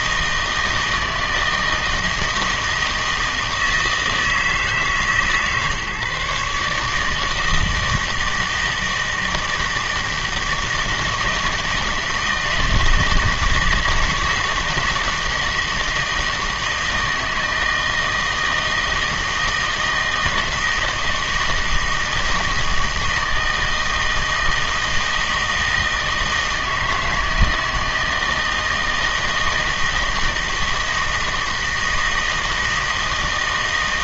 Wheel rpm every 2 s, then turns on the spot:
160, 160, 160, 150, 160, 160, 160, 160, 160, 160, 160, 160, 160, 160, 160, 160, 160.
none